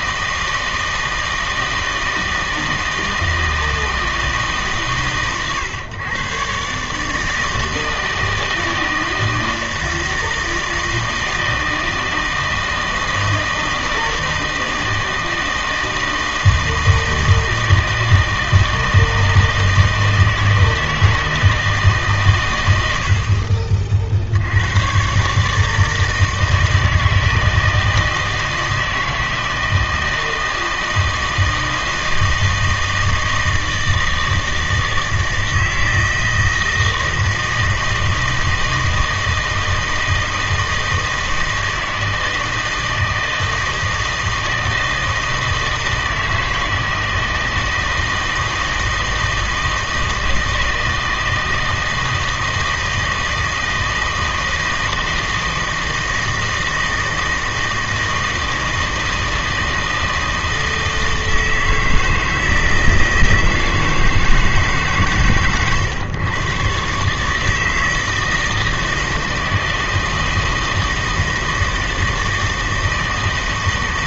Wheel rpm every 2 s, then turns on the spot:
160, 160, 150, 130, 160, 160, 160, 160, 160, 160, 160, 100, 100, 160, 160, 160, 160, 160, 160, 160, 160, 160, 160, 160, 160, 160, 160, 160, 160, 160, 160, 160, 150, 130, 160, 160, 160.
none